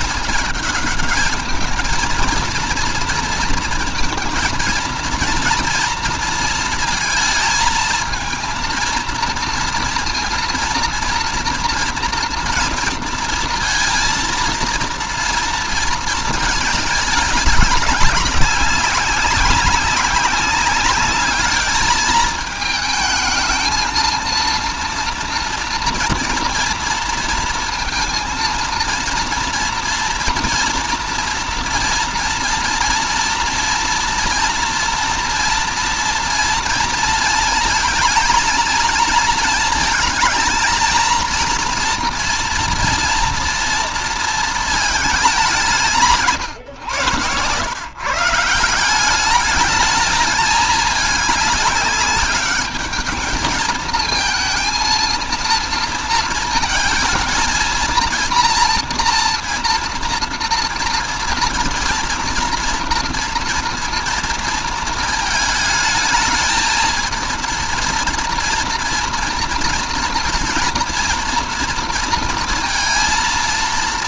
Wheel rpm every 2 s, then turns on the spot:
220, 230, 230, 220, 230, 230, 230, 230, 210, 190, 210, 220, 230, 230, 230, 240, 230, 230, 230, 230, 230, 230, 210, 120, 190, 210, 210, 230, 230, 230, 230, 230, 220, 220, 230, 230, 230.
none